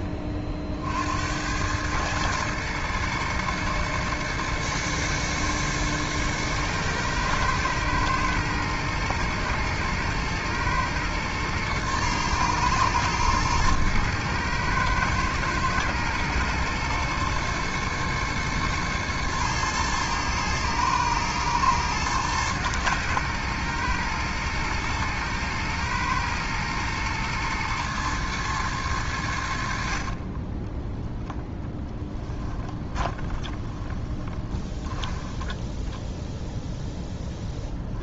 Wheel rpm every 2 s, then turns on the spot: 50, 110, 110, 110, 120, 110, 120, 110, 120, 110, 110, 110, 110, 120, 110, 10, 20, 10, 0.
30-34